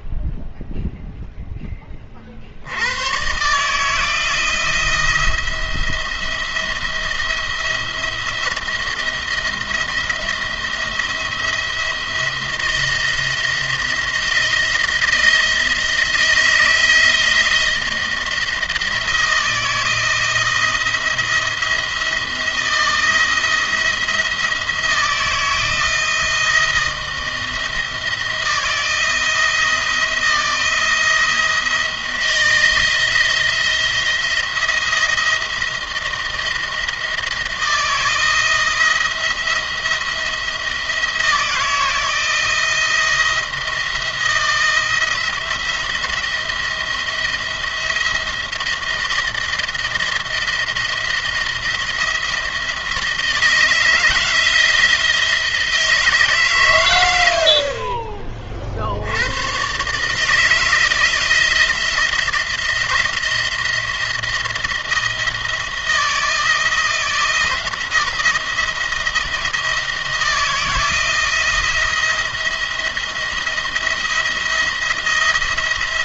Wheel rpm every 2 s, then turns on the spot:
0, 60, 170, 170, 170, 170, 170, 160, 160, 160, 160, 160, 160, 160, 160, 170, 170, 170, 160, 170, 170, 170, 170, 170, 170, 170, 160, 160, 130, 50, 160, 170, 170, 160, 170, 170, 170, 170.
none